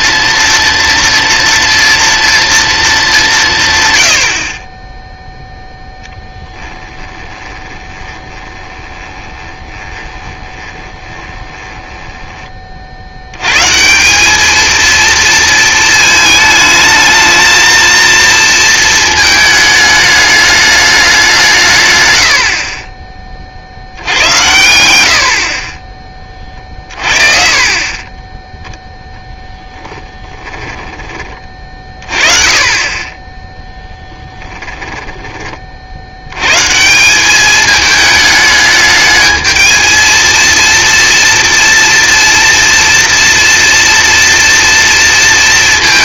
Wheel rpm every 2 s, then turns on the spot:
230, 230, 30, 10, 20, 20, 30, 220, 220, 220, 210, 50, 90, 40, 10, 10, 30, 10, 140, 210, 230, 230, 230.
6-12 28-32 34-36